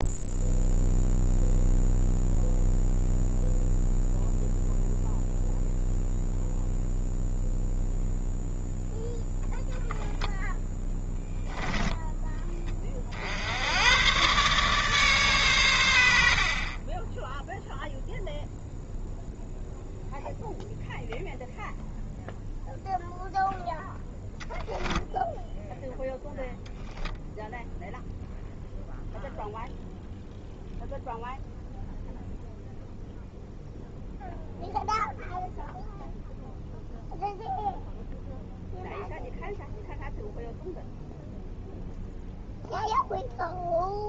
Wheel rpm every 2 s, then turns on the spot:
0, 0, 0, 0, 0, 10, 30, 140, 20, 0, 0, 0, 0, 0, 0, 0, 0, 0, 0, 0, 0, 0.
none